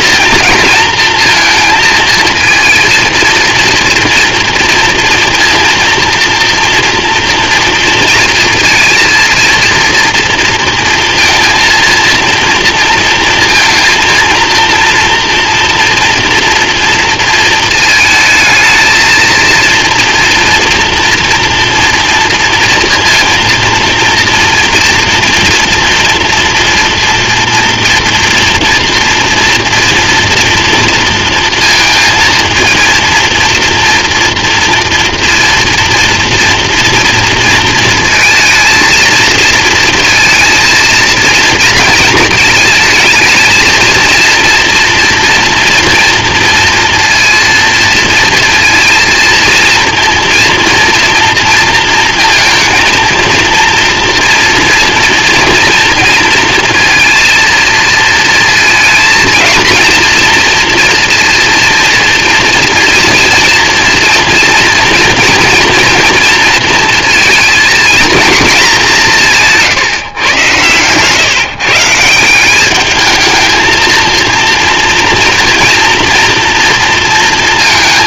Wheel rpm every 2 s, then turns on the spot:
230, 230, 230, 240, 230, 230, 230, 230, 230, 220, 230, 230, 230, 230, 230, 230, 230, 230, 230, 220, 230, 220, 230, 230, 230, 230, 230, 230, 230, 230, 230, 230, 240, 230, 200, 130, 200, 240, 230.
none